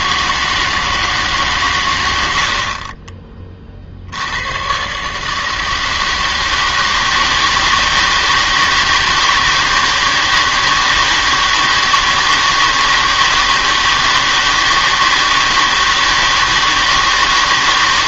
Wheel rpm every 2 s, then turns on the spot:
160, 60, 110, 160, 160, 160, 160, 160, 160.
none